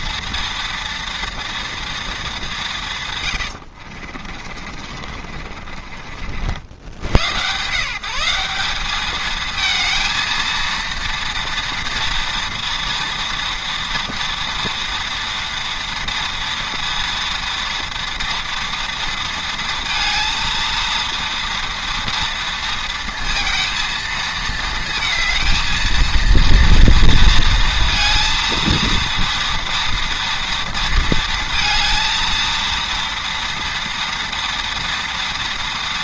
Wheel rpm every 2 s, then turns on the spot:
230, 110, 40, 110, 220, 230, 230, 230, 230, 230, 230, 230, 230, 230, 230, 230, 230, 230.
2-6